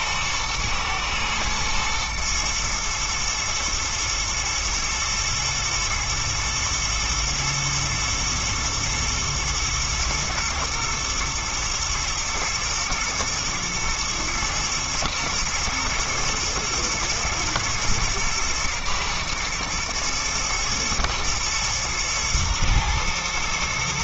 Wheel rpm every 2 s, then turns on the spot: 120, 110, 110, 110, 110, 120, 120, 110, 120, 120, 120, 110.
none